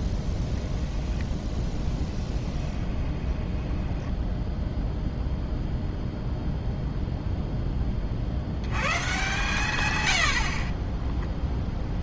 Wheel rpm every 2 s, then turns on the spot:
10, 10, 0, 0, 100, 40.
2-4